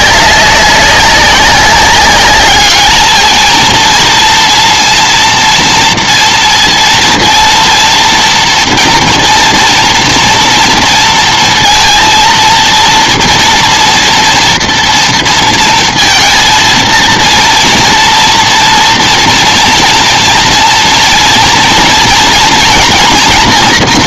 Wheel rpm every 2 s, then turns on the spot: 200, 200, 230, 230, 230, 240, 230, 240, 230, 240, 240, 230.
none